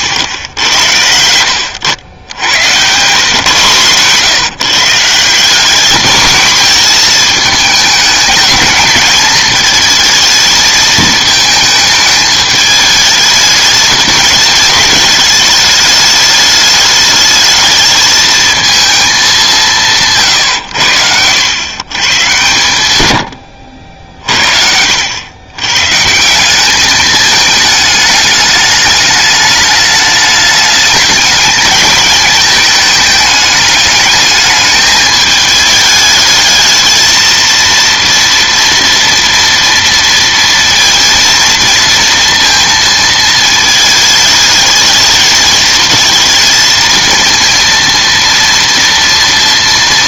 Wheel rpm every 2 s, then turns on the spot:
70, 110, 150, 230, 220, 220, 210, 210, 210, 220, 100, 100, 70, 200, 210, 210, 220, 210, 220, 230, 230, 230, 220, 220, 230.
none